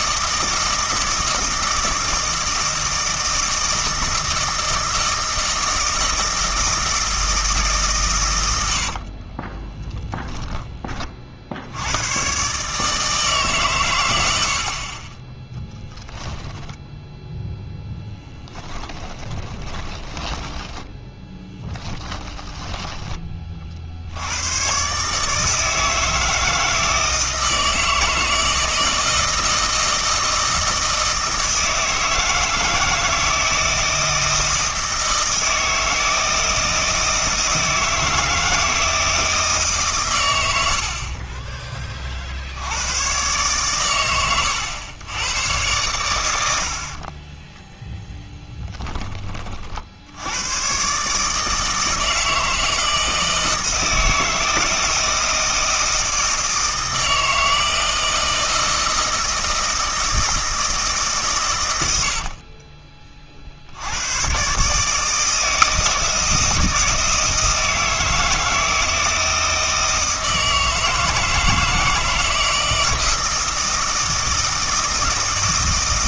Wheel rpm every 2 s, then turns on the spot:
160, 160, 160, 160, 90, 20, 150, 50, 10, 10, 10, 10, 120, 160, 160, 160, 160, 160, 160, 160, 70, 80, 110, 80, 10, 120, 160, 160, 160, 160, 150, 30, 140, 160, 160, 160, 160, 160.
16-22 62-64